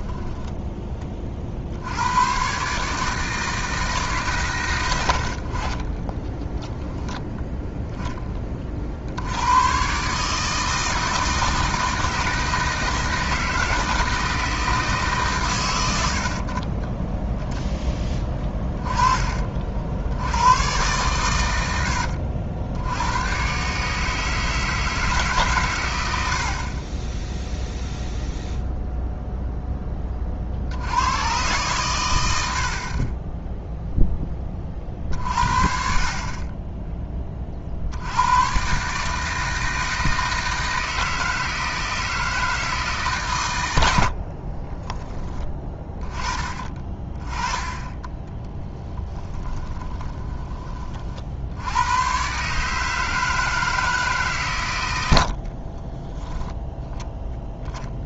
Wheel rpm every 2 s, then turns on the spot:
10, 130, 120, 10, 30, 160, 160, 160, 30, 20, 110, 80, 160, 50, 0, 60, 60, 30, 30, 120, 160, 160, 30, 20, 10, 20, 150, 130, 10.
0-2 6-8 18-20 44-46 48-50